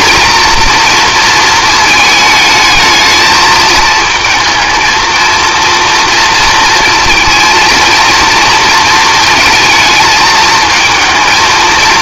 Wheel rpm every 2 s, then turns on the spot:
230, 220, 220, 230, 230, 220.
none